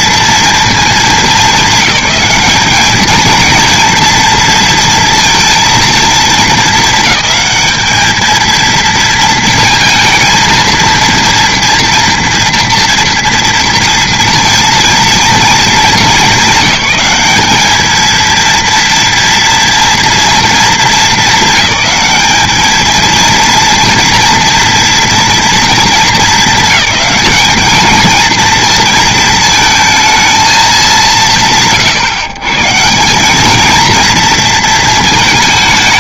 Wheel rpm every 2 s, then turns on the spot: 220, 220, 230, 220, 230, 230, 230, 230, 200, 230, 200, 230, 230, 210, 220, 120, 160, 230.
none